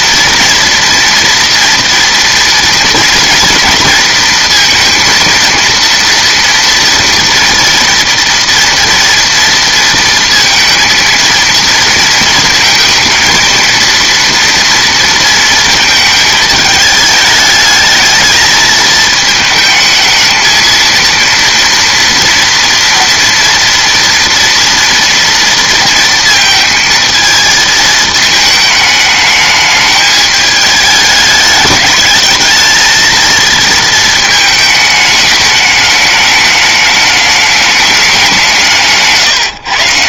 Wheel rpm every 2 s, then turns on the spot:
240, 230, 230, 240, 240, 230, 230, 230, 220, 220, 230, 230, 230, 230, 210, 210, 220, 220, 210, 170.
none